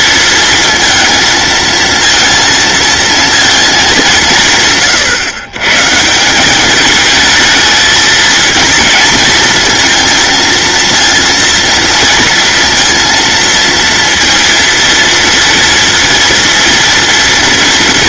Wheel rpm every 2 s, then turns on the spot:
230, 230, 150, 200, 230, 230, 230, 230, 230.
none